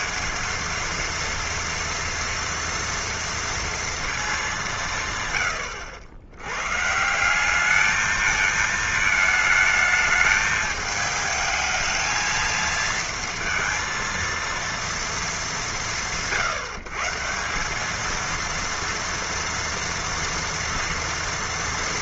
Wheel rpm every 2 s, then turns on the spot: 220, 230, 180, 130, 220, 220, 230, 230, 140, 230, 230.
none